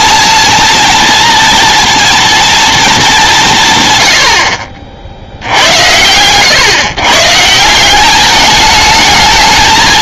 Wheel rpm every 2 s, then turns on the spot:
220, 230, 90, 100, 200.
none